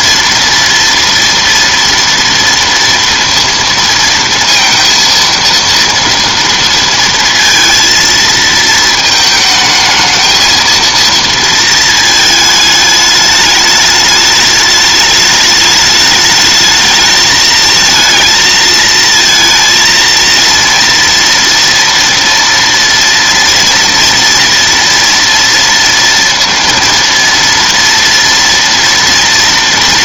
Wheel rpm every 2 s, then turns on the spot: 230, 230, 230, 230, 220, 220, 210, 210, 220, 230, 230, 230, 230, 230, 230.
none